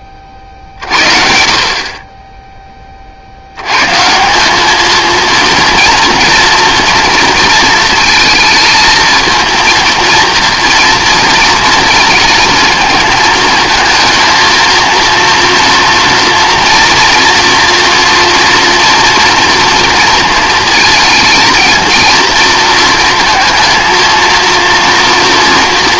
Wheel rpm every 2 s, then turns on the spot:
40, 10, 200, 230, 220, 230, 220, 230, 240, 230, 230, 230, 230.
none